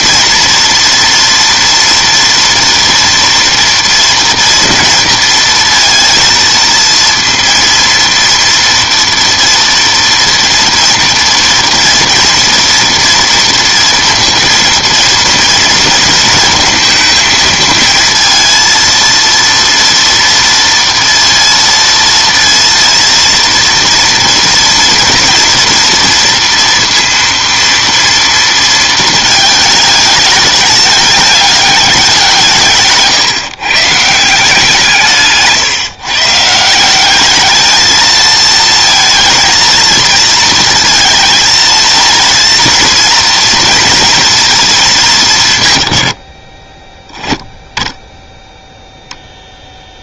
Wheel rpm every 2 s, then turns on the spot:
230, 230, 230, 230, 230, 230, 230, 230, 230, 230, 230, 230, 240, 230, 230, 210, 160, 170, 160, 230, 230, 230, 230, 20, 0.
none